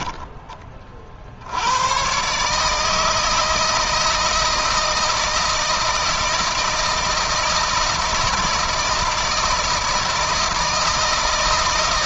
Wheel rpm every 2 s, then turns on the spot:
30, 150, 160, 160, 160, 160.
none